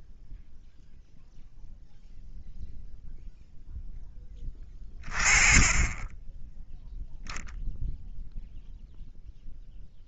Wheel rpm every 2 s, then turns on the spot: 0, 10, 10, 0, 0.
none